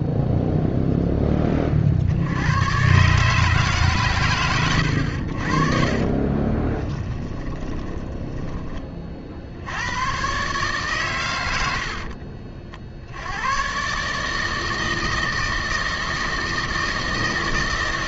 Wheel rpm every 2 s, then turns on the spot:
0, 120, 100, 20, 30, 130, 60, 160, 160.
6-8